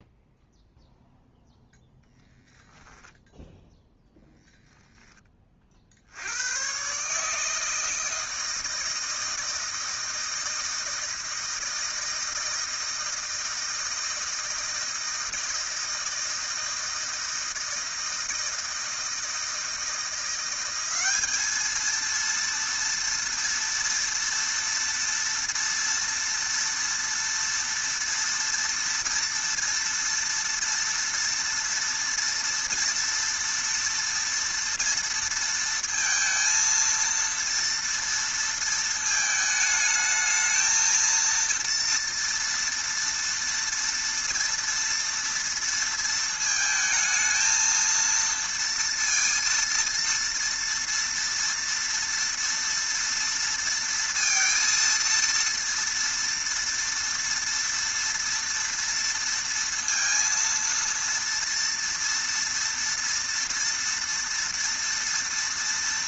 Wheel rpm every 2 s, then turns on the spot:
0, 0, 0, 120, 160, 160, 160, 160, 160, 160, 190, 230, 230, 240, 230, 230, 230, 230, 230, 230, 220, 230, 230, 220, 230, 230, 230, 230, 230, 230, 230, 230, 230.
none